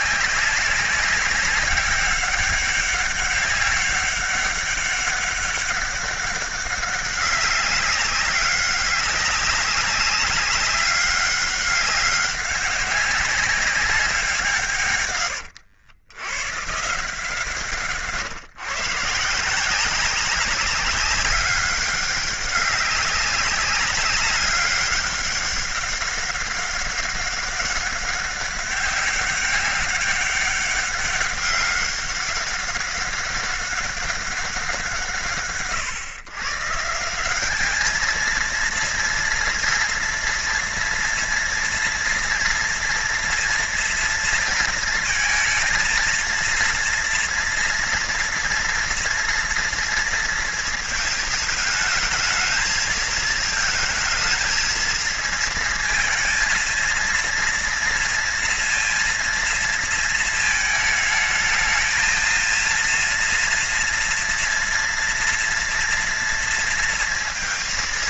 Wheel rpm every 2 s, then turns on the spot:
200, 200, 200, 200, 190, 200, 200, 140, 150, 140, 190, 200, 200, 200, 200, 200, 200, 190, 150, 230, 230, 230, 230, 230, 230, 230, 220, 220, 230, 230, 220, 230, 230, 230.
none